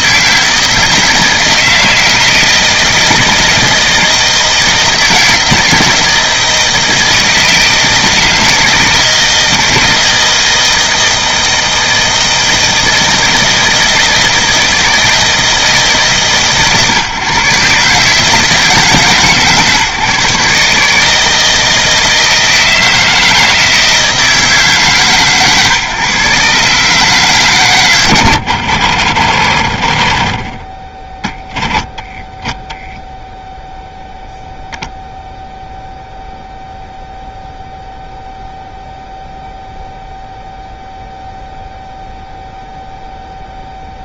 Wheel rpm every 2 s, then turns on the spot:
160, 160, 160, 160, 160, 160, 160, 160, 130, 140, 150, 160, 140, 140, 60, 10, 0, 0, 0, 0, 0, 0.
none